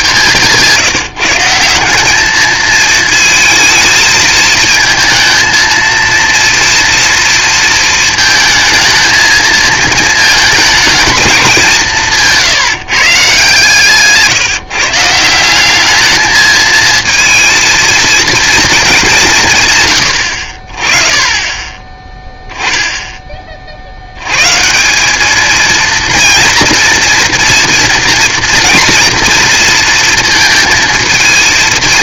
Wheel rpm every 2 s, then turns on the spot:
170, 220, 230, 230, 220, 220, 150, 150, 220, 220, 40, 10, 150, 230, 240, 230.
none